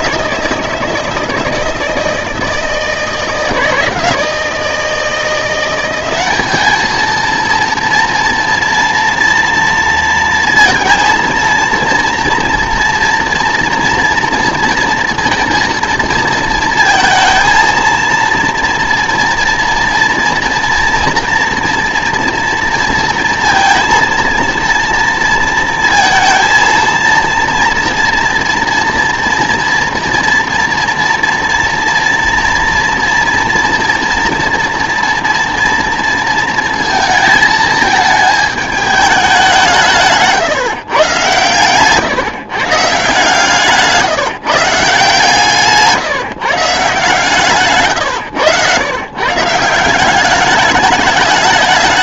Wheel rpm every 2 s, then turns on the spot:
160, 160, 160, 210, 230, 230, 230, 230, 230, 230, 240, 230, 230, 230, 240, 240, 240, 230, 230, 210, 130, 150, 160, 150, 110, 200.
none